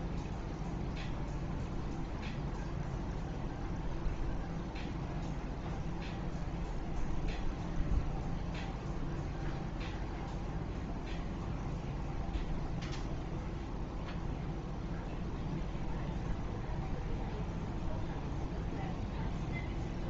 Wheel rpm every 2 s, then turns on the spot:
0, 0, 0, 0, 0, 0, 0, 0, 0, 0.
none